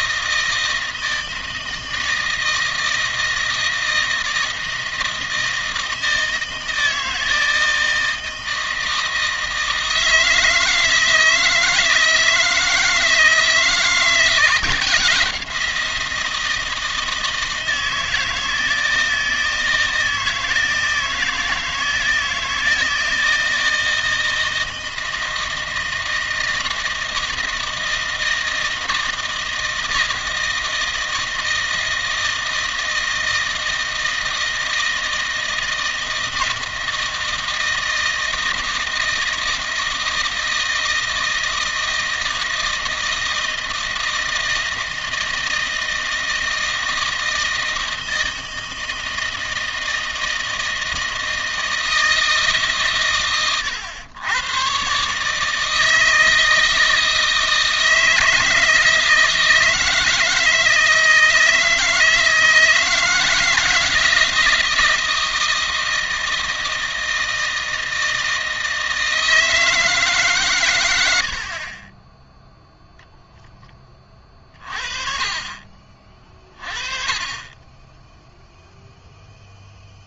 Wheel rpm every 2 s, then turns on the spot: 160, 160, 160, 160, 160, 160, 160, 170, 160, 160, 160, 160, 160, 160, 160, 160, 160, 160, 160, 160, 160, 160, 160, 160, 160, 160, 140, 120, 160, 160, 160, 160, 160, 160, 160, 110, 0, 30, 40, 0.
none